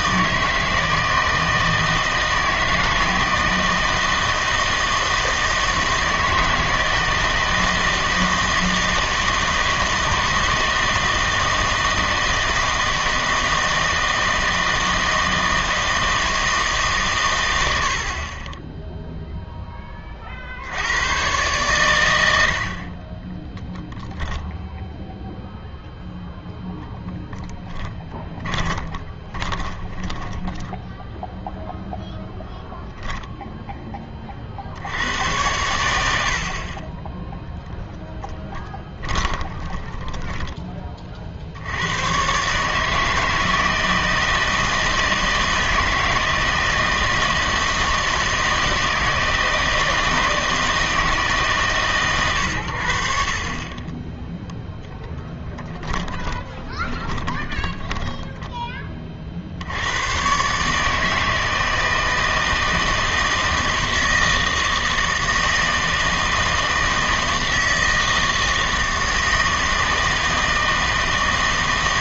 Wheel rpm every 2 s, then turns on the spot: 160, 160, 160, 160, 160, 160, 160, 160, 150, 10, 70, 60, 0, 0, 20, 10, 0, 70, 40, 10, 30, 150, 160, 160, 160, 160, 80, 0, 20, 10, 140, 160, 160, 160, 160, 160.
28-32 38-40 56-58